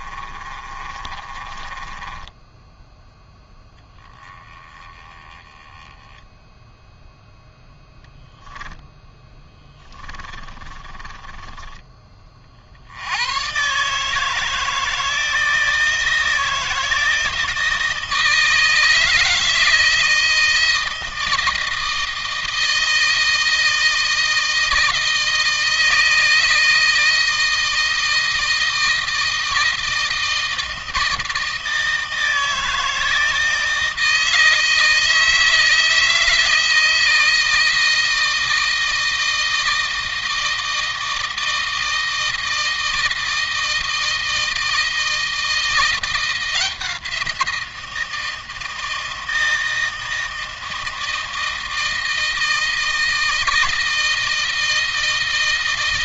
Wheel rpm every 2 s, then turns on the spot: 30, 10, 20, 0, 0, 20, 80, 160, 160, 160, 160, 160, 160, 160, 160, 160, 160, 160, 160, 160, 160, 160, 160, 170, 160, 160, 160, 160.
0-2 10-12